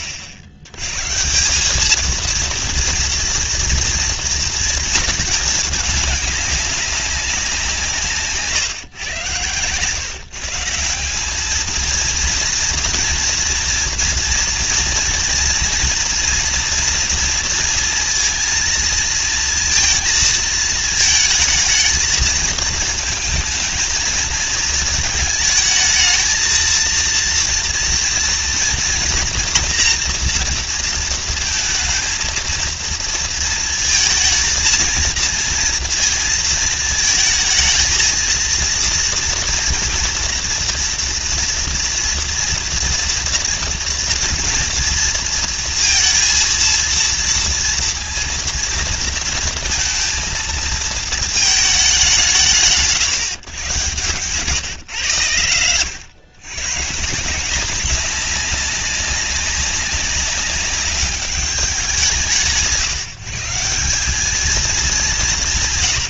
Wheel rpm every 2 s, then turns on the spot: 90, 230, 230, 200, 120, 170, 230, 230, 230, 220, 220, 220, 220, 230, 230, 230, 230, 220, 220, 230, 230, 230, 230, 230, 230, 220, 110, 120, 140, 200, 200, 150, 200.
none